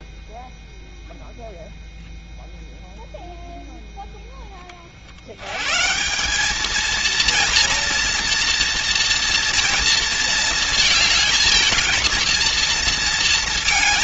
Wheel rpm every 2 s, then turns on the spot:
0, 0, 70, 230, 230, 220, 230.
none